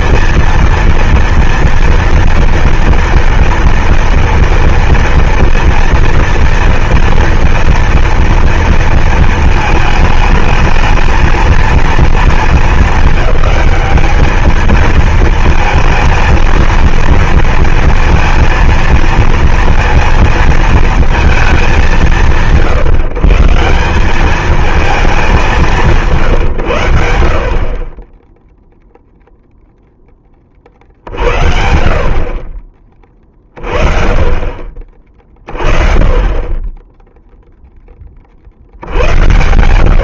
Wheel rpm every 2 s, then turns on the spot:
230, 230, 230, 230, 230, 220, 220, 220, 230, 230, 230, 140, 210, 100, 0, 50, 30, 40, 20, 70.
none